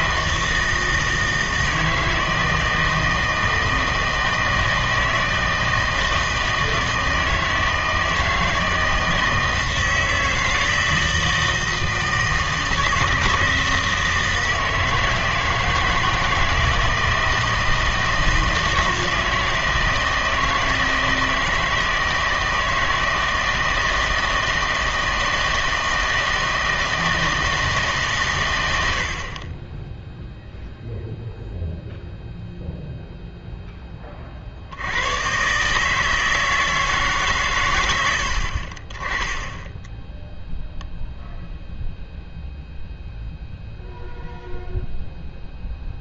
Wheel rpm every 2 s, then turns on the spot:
160, 160, 160, 160, 160, 160, 160, 160, 160, 160, 160, 160, 160, 160, 110, 0, 0, 50, 160, 60, 0, 0, 0.
none